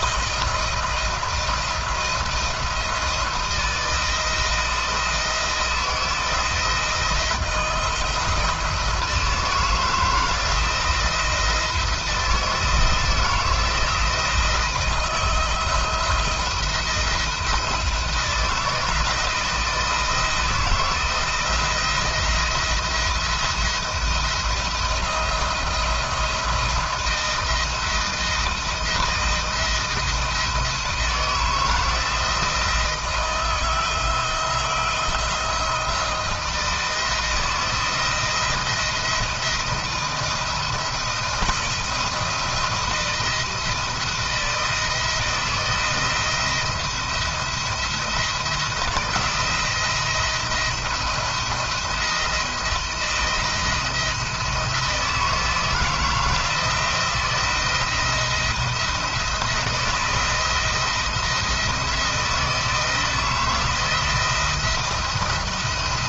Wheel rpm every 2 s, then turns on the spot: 160, 170, 170, 170, 160, 160, 160, 160, 170, 170, 160, 170, 170, 170, 170, 160, 160, 160, 160, 170, 170, 170, 160, 170, 160, 170, 170, 160, 170, 170, 170, 170, 170.
none